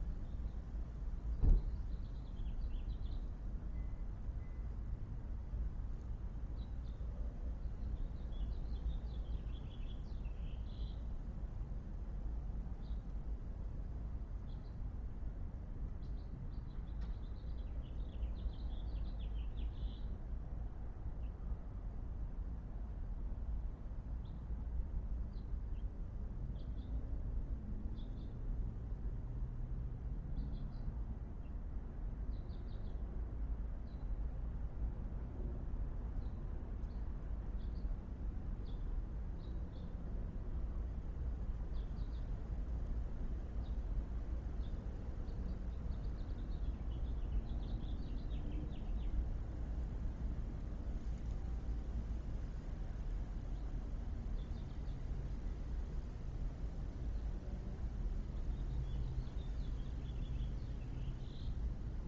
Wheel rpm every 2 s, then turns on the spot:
0, 0, 0, 0, 0, 0, 0, 0, 0, 0, 0, 0, 0, 0, 0, 0, 0, 0, 0, 0, 0, 0, 0, 0, 0, 0, 0, 0, 0, 0, 0.
none